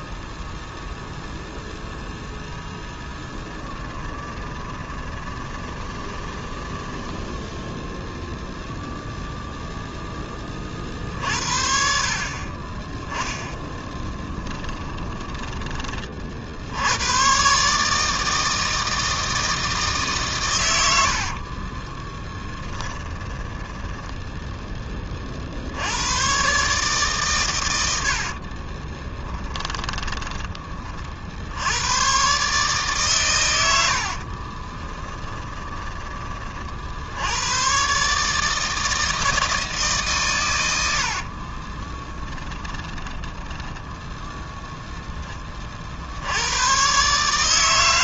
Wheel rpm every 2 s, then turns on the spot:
0, 10, 20, 10, 0, 30, 30, 10, 80, 160, 100, 10, 10, 130, 40, 20, 140, 20, 50, 160, 90, 10, 0, 100.
4-8 14-16 22-24 28-30 34-36 42-44